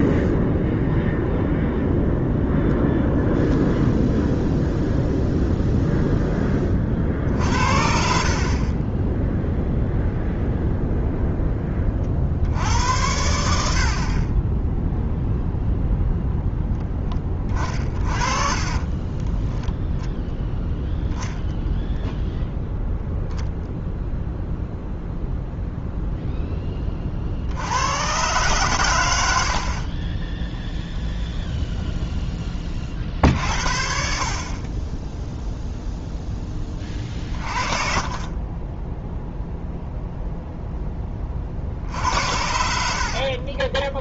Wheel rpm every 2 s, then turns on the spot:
0, 0, 0, 40, 20, 0, 80, 0, 10, 30, 0, 0, 0, 20, 120, 0, 40, 20, 20, 10, 10, 60.
18-20 38-40 42-44